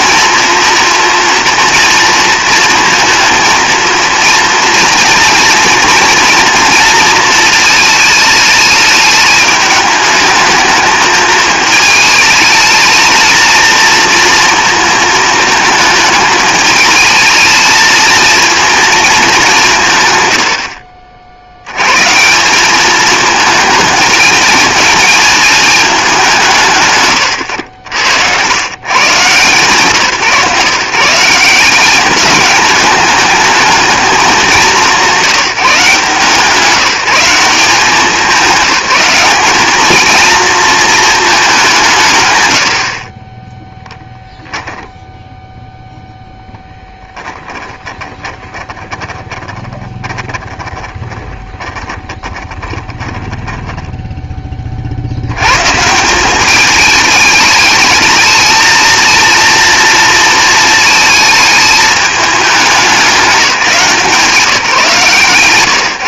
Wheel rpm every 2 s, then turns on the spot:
230, 220, 230, 230, 210, 220, 220, 230, 220, 230, 80, 200, 220, 110, 120, 150, 210, 170, 170, 200, 220, 80, 10, 10, 10, 10, 10, 40, 210, 230, 220, 210, 150.
46-54